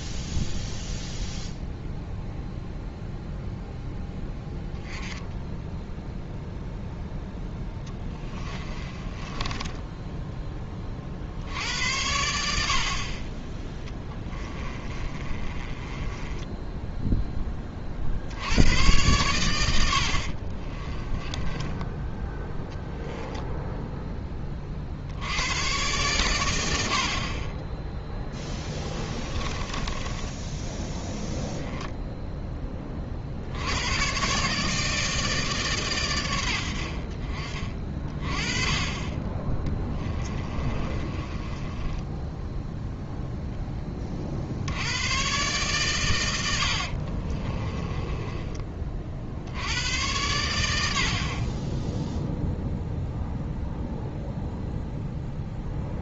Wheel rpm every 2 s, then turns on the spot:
0, 0, 10, 0, 20, 20, 70, 30, 10, 90, 30, 10, 30, 90, 10, 10, 20, 150, 70, 30, 30, 0, 70, 80, 30, 90, 0, 0.
8-10 14-18 20-22 28-30 40-42 46-48